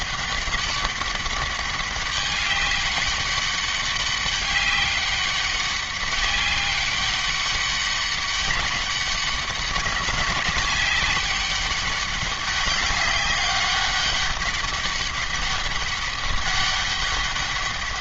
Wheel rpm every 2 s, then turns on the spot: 200, 200, 200, 200, 200, 200, 200, 200, 200.
none